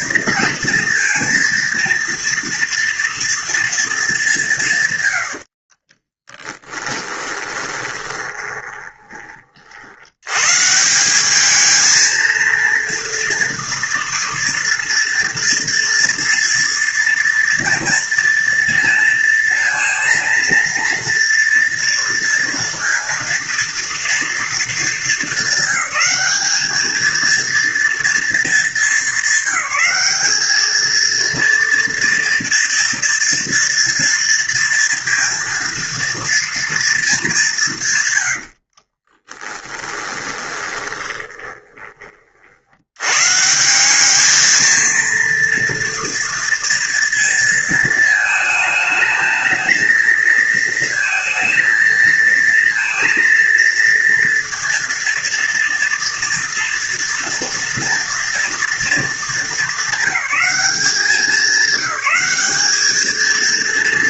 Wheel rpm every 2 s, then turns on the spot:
230, 230, 110, 20, 30, 180, 230, 230, 230, 230, 240, 230, 210, 220, 200, 230, 230, 230, 220, 40, 20, 110, 230, 230, 220, 230, 230, 230, 230, 220, 200, 220.
6-8 38-42